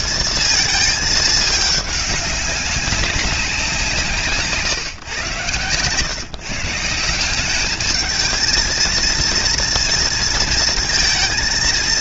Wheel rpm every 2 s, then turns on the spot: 230, 210, 160, 120, 210, 230.
none